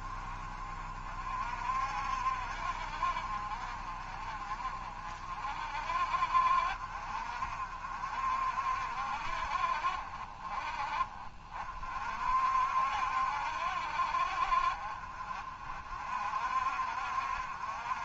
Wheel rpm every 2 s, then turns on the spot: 50, 50, 50, 50, 60, 40, 70, 40, 60.
none